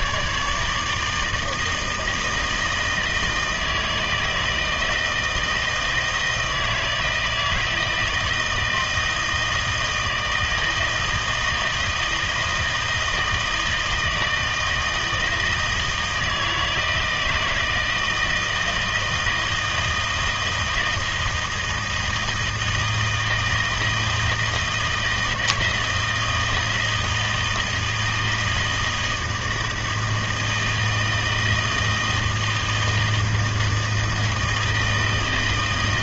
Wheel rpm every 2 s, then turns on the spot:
150, 160, 160, 160, 160, 160, 160, 160, 160, 160, 160, 160, 160, 160, 160, 160, 160, 160.
none